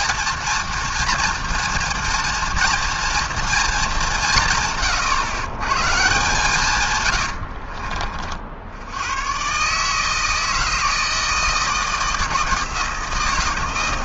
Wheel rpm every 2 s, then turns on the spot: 240, 230, 140, 130, 90, 160, 160.
none